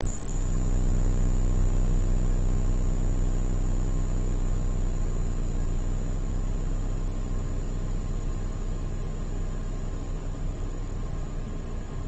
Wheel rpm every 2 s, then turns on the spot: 0, 0, 0, 0, 0, 0.
none